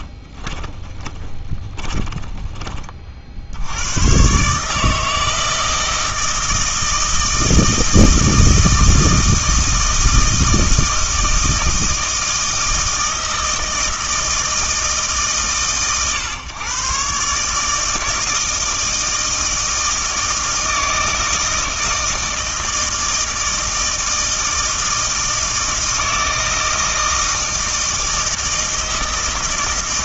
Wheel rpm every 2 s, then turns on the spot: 20, 30, 150, 160, 160, 160, 160, 160, 130, 160, 160, 160, 160, 160, 160.
0-4